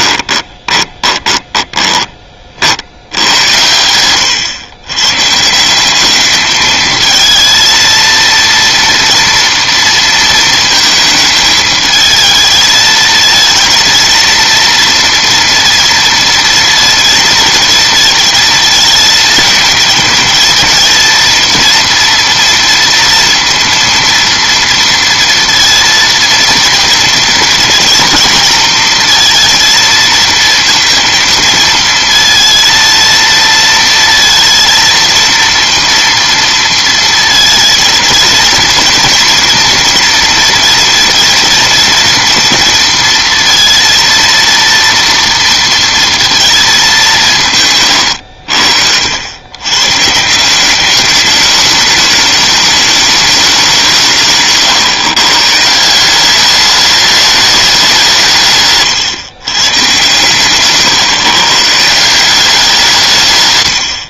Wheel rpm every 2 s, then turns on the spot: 20, 60, 120, 220, 230, 220, 220, 230, 230, 230, 230, 230, 230, 230, 230, 230, 230, 230, 230, 220, 230, 230, 230, 210, 70, 190, 210, 140, 200, 150, 140, 180.
0-2